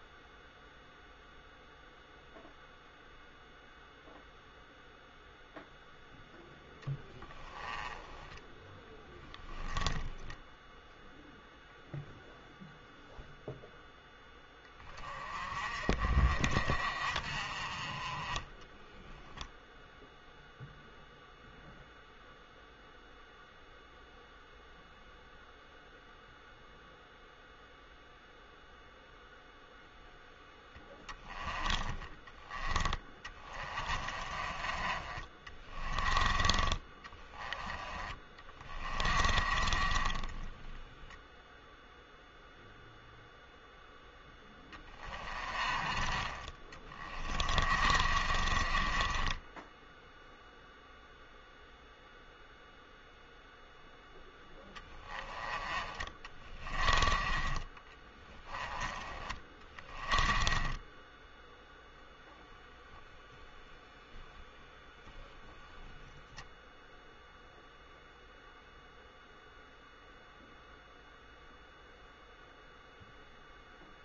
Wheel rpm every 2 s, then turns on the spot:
0, 0, 0, 0, 10, 0, 0, 20, 40, 10, 0, 0, 0, 0, 0, 10, 20, 30, 30, 30, 10, 0, 10, 30, 30, 0, 0, 10, 20, 20, 20, 0, 0, 0, 0, 0, 0.
18-20 34-36 38-42 44-50 56-58 60-62